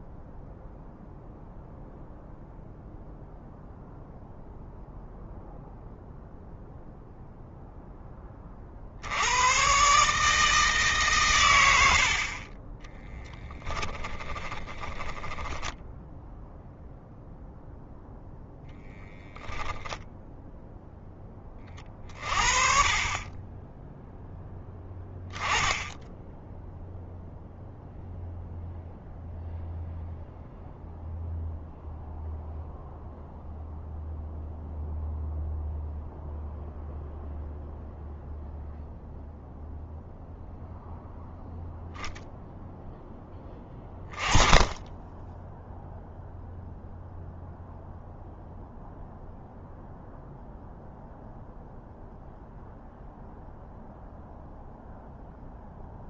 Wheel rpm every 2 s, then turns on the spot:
0, 0, 0, 0, 70, 140, 20, 20, 0, 0, 10, 30, 10, 0, 0, 0, 0, 0, 0, 0, 0, 10, 10, 0, 0, 0, 0, 0.
12-16